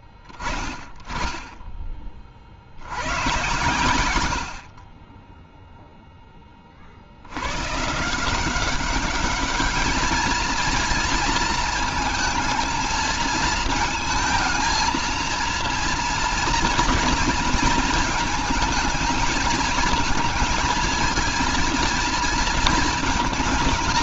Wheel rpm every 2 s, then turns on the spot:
20, 100, 30, 90, 210, 230, 220, 230, 230, 220, 230, 220.
none